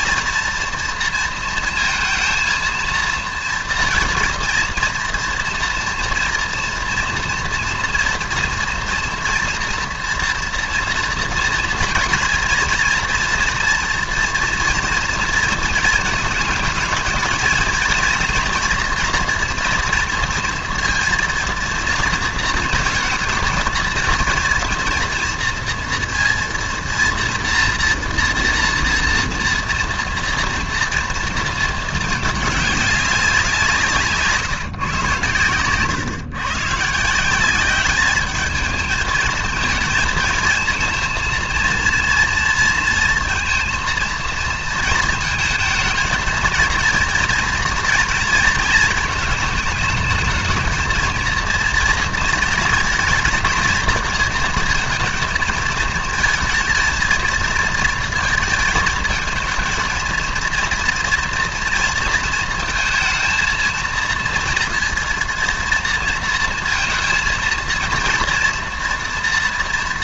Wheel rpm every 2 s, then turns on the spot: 230, 230, 230, 240, 240, 240, 230, 230, 220, 230, 230, 230, 230, 230, 230, 230, 210, 150, 140, 210, 230, 230, 230, 230, 230, 220, 230, 230, 220, 220, 230, 230, 230, 230, 230.
none